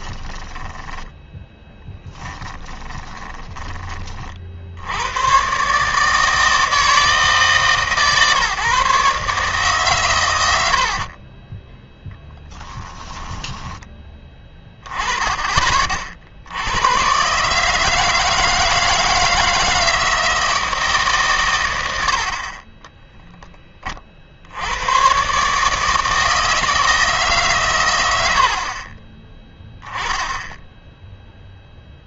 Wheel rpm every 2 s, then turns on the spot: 10, 10, 70, 160, 150, 80, 10, 20, 90, 160, 160, 30, 80, 160, 50, 10.
0-4 10-14